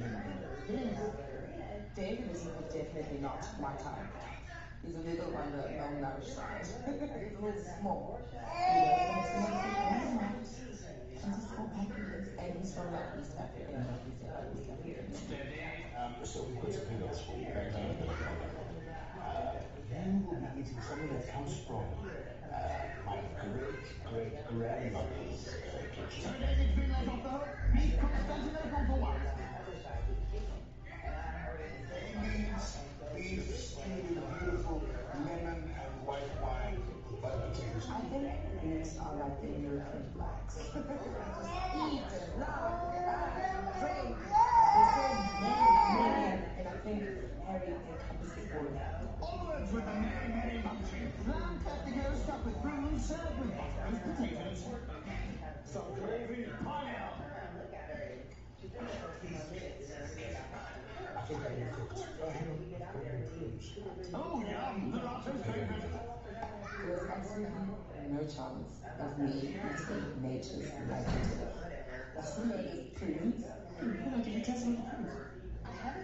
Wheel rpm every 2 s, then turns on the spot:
0, 0, 0, 0, 0, 0, 0, 0, 0, 0, 0, 0, 0, 0, 0, 0, 0, 0, 0, 0, 0, 0, 0, 0, 0, 0, 0, 0, 0, 0, 0, 0, 0, 0, 0, 0, 0, 0.
none